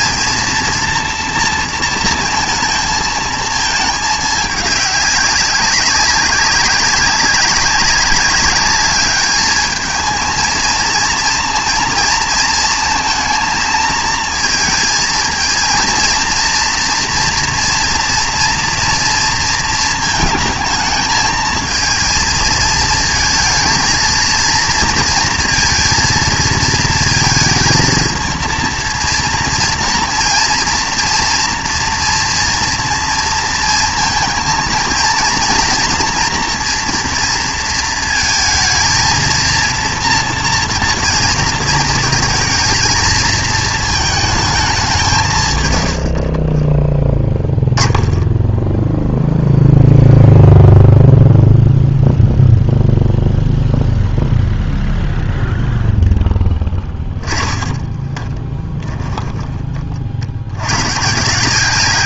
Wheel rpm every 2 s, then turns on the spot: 230, 220, 200, 200, 210, 220, 230, 230, 230, 240, 220, 220, 230, 230, 230, 230, 240, 230, 240, 220, 230, 220, 210, 30, 0, 0, 0, 0, 10, 20, 110.
46-48 56-60